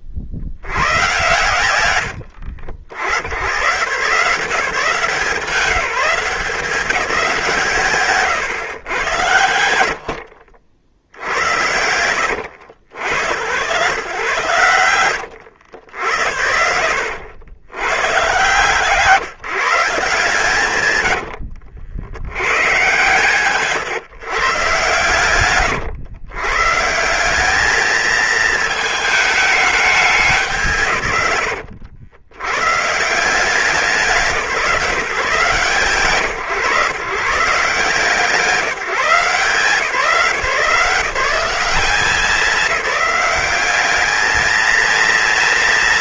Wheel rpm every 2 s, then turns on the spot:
70, 60, 170, 200, 110, 70, 80, 110, 80, 130, 130, 110, 130, 130, 220, 150, 130, 150, 130, 160, 170, 200, 210.
none